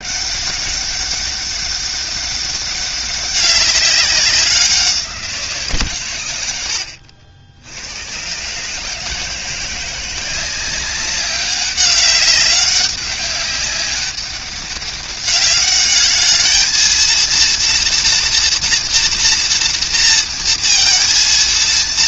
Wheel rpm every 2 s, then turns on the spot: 200, 200, 180, 90, 140, 190, 200, 200, 220, 230, 230.
none